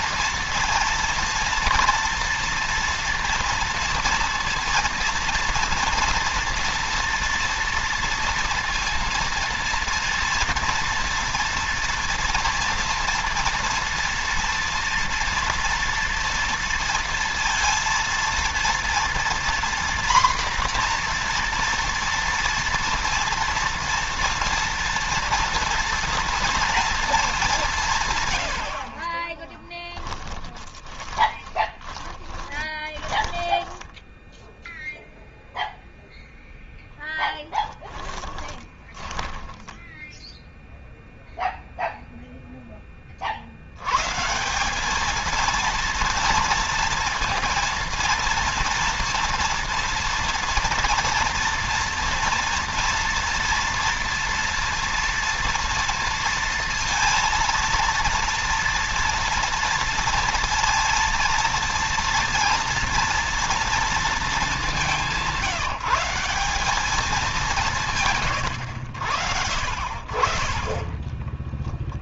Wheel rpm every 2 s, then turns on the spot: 230, 230, 230, 230, 230, 230, 230, 230, 230, 230, 240, 230, 230, 230, 60, 20, 10, 0, 10, 20, 0, 20, 210, 230, 230, 230, 230, 230, 230, 240, 230, 230, 190, 210, 90, 20.
28-34 38-40